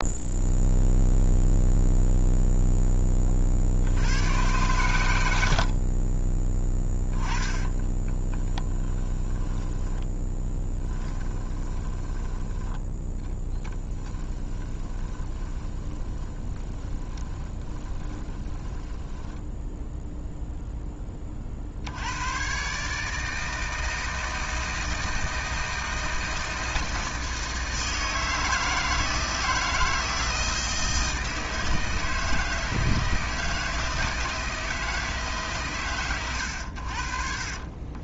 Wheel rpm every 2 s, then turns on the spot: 0, 10, 110, 20, 10, 10, 10, 20, 20, 10, 10, 150, 160, 160, 160, 160, 160, 160, 70.
6-12 14-20